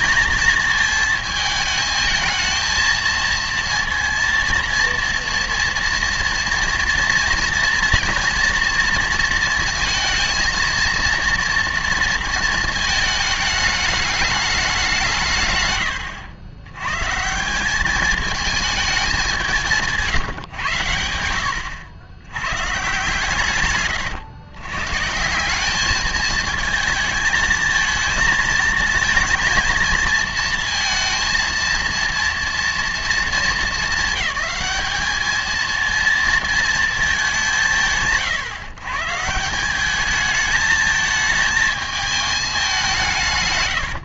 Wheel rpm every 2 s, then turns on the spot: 220, 230, 230, 230, 230, 230, 220, 210, 100, 210, 110, 130, 130, 220, 220, 230, 230, 200, 230, 140, 220, 200.
none